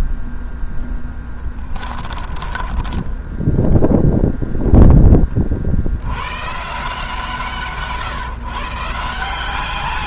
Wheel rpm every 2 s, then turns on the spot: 0, 10, 20, 140, 160.
2-4